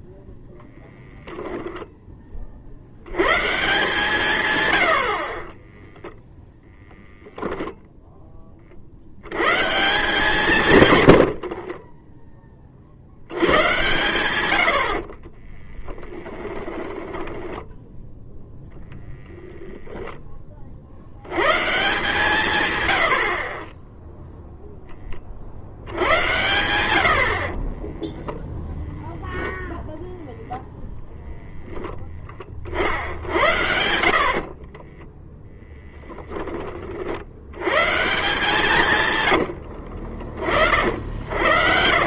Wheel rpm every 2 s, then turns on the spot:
0, 40, 120, 0, 20, 160, 30, 90, 10, 0, 30, 120, 0, 90, 10, 0, 40, 40, 20, 140, 70.
16-18 34-36